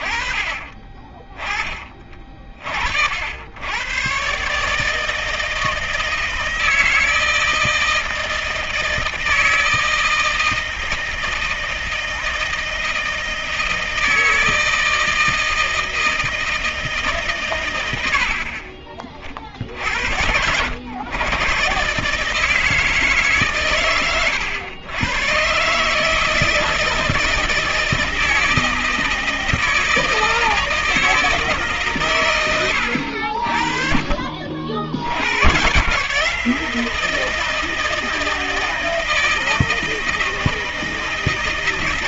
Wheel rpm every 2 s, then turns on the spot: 30, 40, 140, 160, 160, 160, 160, 160, 160, 50, 80, 160, 110, 160, 160, 160, 120, 50, 150, 160, 160.
none